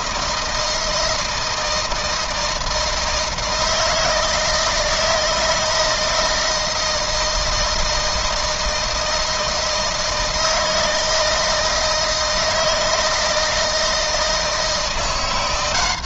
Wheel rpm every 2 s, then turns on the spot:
160, 160, 160, 160, 160, 160, 160, 170.
none